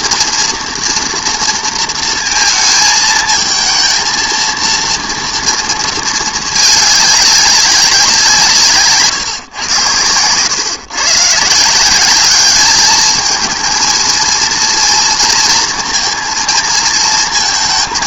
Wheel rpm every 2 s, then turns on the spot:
240, 220, 230, 210, 150, 120, 210, 230, 230.
none